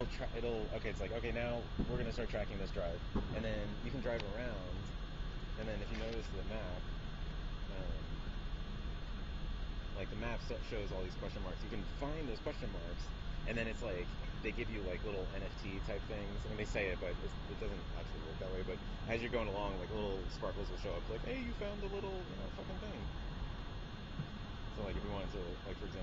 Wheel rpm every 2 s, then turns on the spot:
0, 0, 0, 0, 0, 0, 0, 0, 0, 0, 0, 0, 0.
none